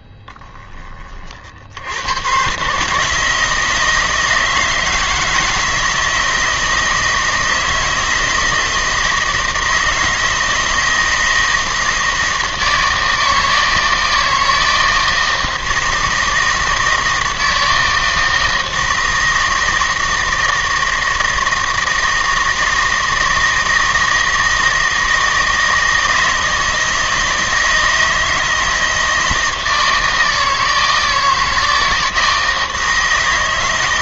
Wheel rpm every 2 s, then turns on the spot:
20, 140, 160, 160, 160, 160, 160, 160, 160, 160, 160, 160, 160, 160, 160, 160, 160.
none